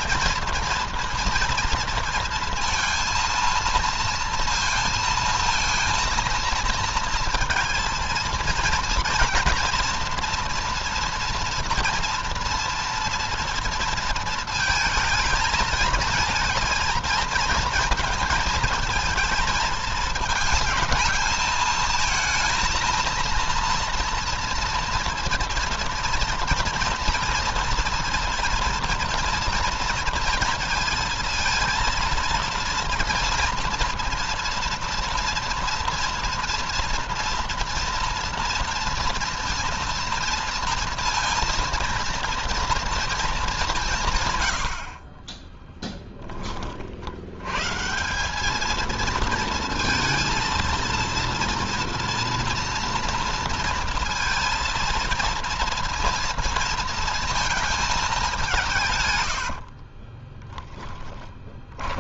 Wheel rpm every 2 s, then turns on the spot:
230, 230, 230, 230, 230, 230, 230, 220, 220, 220, 220, 230, 230, 240, 230, 230, 230, 230, 230, 230, 230, 230, 50, 60, 220, 230, 230, 230, 230, 140, 10.
60-62